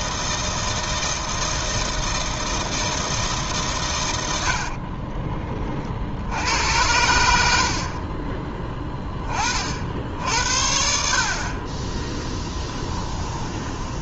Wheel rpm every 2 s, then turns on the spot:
160, 160, 30, 90, 10, 60, 10.
4-6 12-14